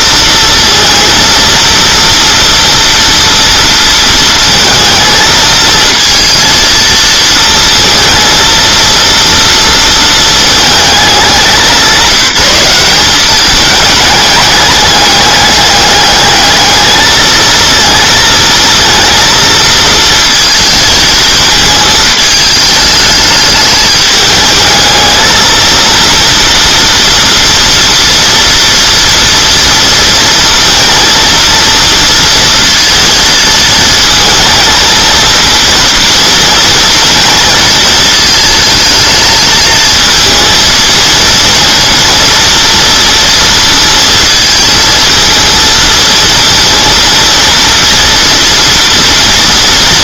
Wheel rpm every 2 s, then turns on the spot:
230, 230, 230, 230, 230, 210, 190, 210, 220, 230, 220, 210, 220, 230, 240, 230, 230, 230, 230, 220, 230, 230, 230, 230, 230.
none